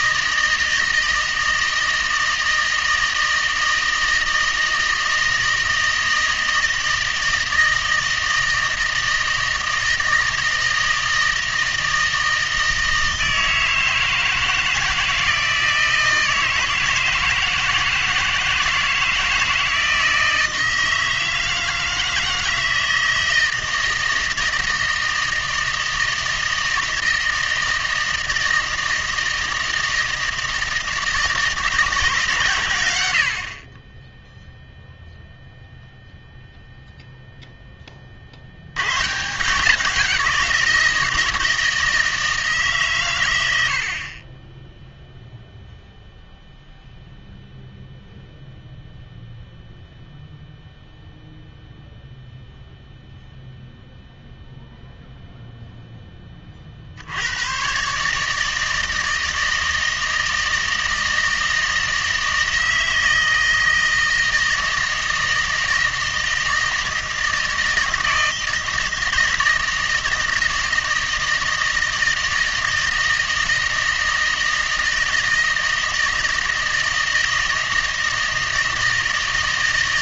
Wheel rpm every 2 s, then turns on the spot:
160, 160, 160, 160, 160, 160, 160, 160, 160, 160, 160, 160, 160, 160, 160, 160, 120, 0, 0, 100, 170, 140, 10, 0, 0, 0, 0, 0, 50, 160, 160, 160, 160, 160, 170, 160, 160, 160, 160, 160.
none